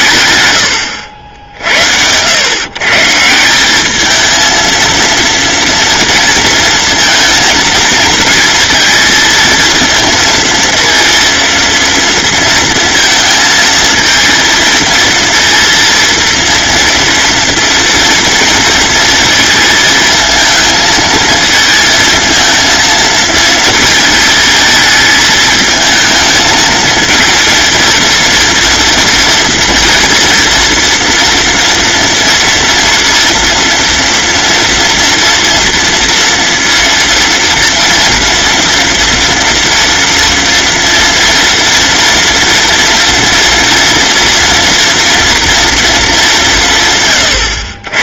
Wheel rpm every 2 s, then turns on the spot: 70, 140, 230, 230, 220, 230, 230, 230, 230, 230, 220, 230, 220, 220, 230, 230, 230, 230, 230, 230, 230, 230, 240, 150.
none